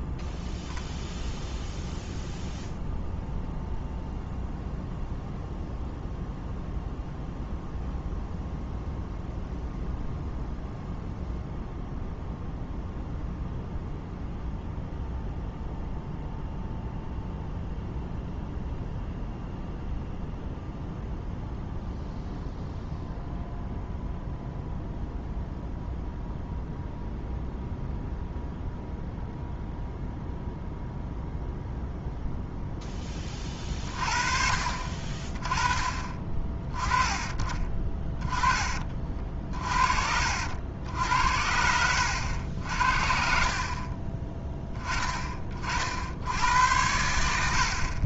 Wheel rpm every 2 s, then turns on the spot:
0, 0, 0, 0, 0, 0, 0, 0, 0, 0, 0, 0, 0, 0, 0, 0, 0, 50, 20, 30, 70, 70, 20, 90.
none